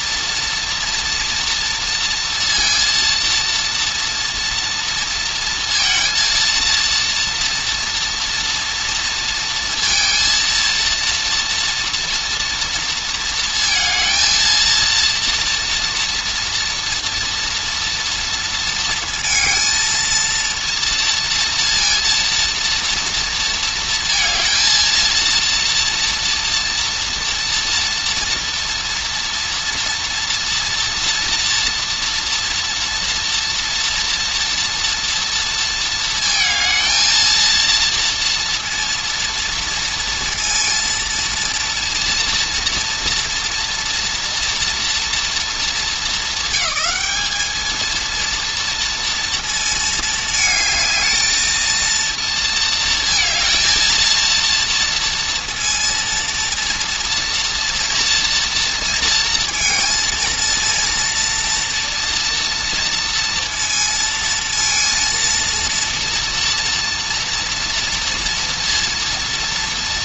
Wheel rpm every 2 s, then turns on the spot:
230, 230, 230, 230, 230, 230, 230, 230, 230, 230, 230, 230, 230, 230, 230, 240, 240, 230, 220, 230, 230, 230, 240, 200, 230, 220, 230, 230, 230, 230, 230, 230, 230, 230, 230.
none